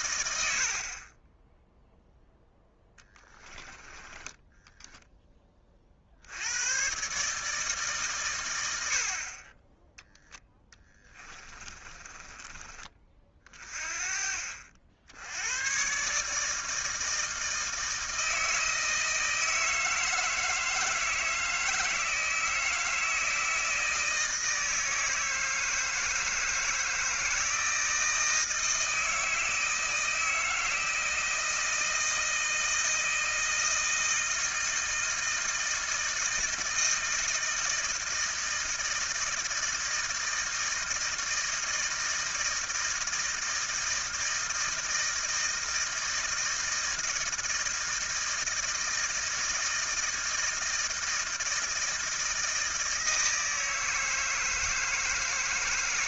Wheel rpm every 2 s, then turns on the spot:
80, 10, 10, 100, 100, 10, 20, 50, 150, 160, 160, 160, 160, 160, 160, 160, 160, 160, 160, 160, 160, 160, 160, 160, 160, 160, 160, 160.
4-6 10-14